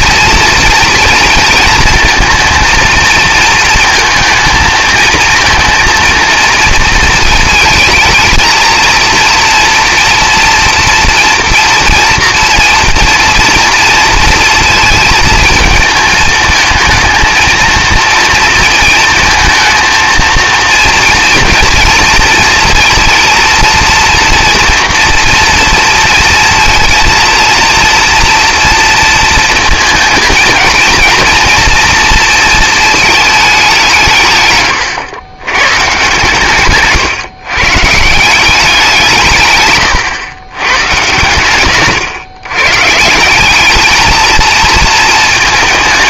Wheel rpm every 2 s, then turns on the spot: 240, 230, 230, 230, 220, 230, 230, 220, 220, 230, 230, 230, 240, 230, 230, 220, 230, 120, 140, 180, 130, 130, 230.
none